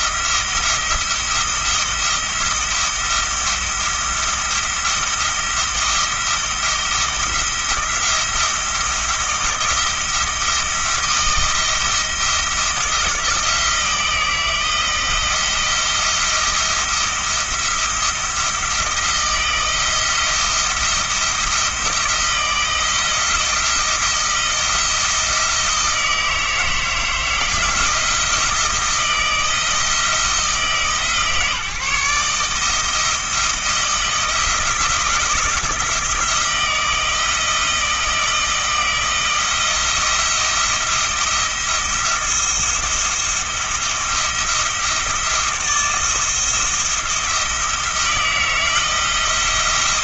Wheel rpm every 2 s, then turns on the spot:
170, 170, 170, 170, 170, 170, 170, 170, 170, 170, 170, 170, 170, 160, 170, 160, 160, 160, 160, 160, 170, 170, 170, 160, 160.
none